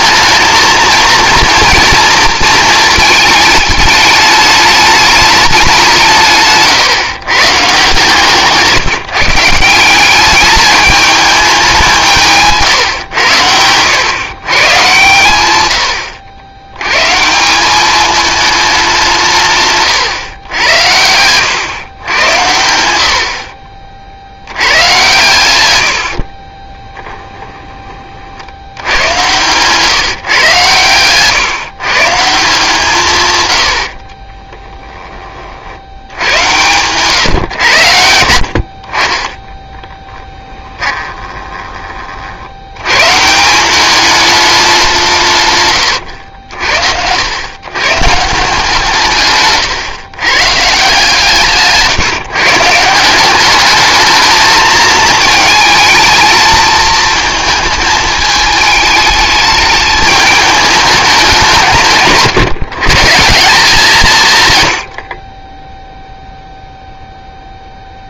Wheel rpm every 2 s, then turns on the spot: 230, 220, 210, 150, 160, 210, 130, 130, 120, 200, 90, 80, 100, 10, 100, 130, 160, 10, 120, 50, 20, 100, 190, 80, 150, 150, 160, 220, 220, 210, 210, 150, 90, 0.
26-28 40-42